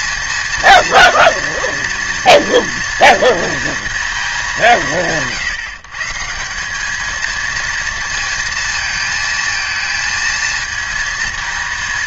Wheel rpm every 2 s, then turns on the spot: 230, 230, 150, 210, 230, 230.
none